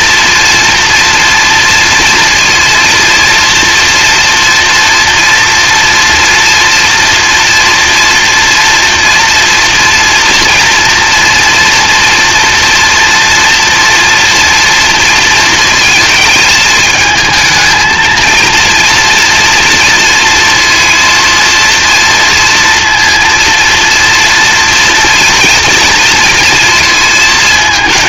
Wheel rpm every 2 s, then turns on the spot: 230, 230, 230, 240, 240, 230, 230, 240, 220, 230, 230, 230, 230, 230.
none